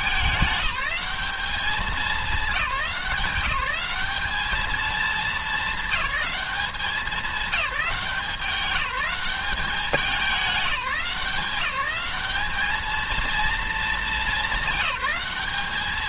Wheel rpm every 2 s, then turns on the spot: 200, 180, 220, 200, 200, 190, 220, 210.
none